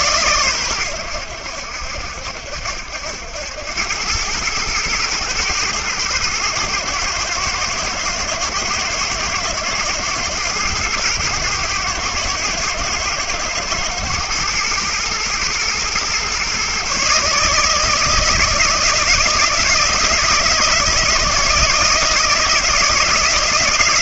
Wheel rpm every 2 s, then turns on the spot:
110, 70, 110, 120, 110, 120, 110, 110, 130, 160, 170, 170.
none